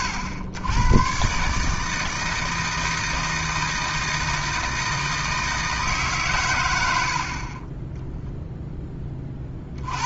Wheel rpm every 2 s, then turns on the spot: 110, 160, 160, 110, 20.
none